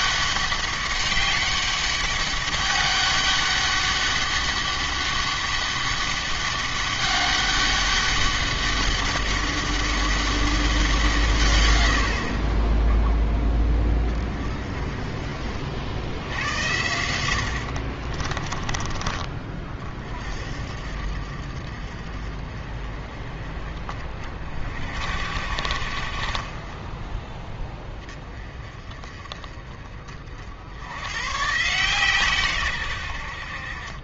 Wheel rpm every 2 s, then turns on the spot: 190, 200, 200, 200, 200, 190, 20, 30, 80, 20, 50, 40, 50, 10, 30, 80, 120.
18-20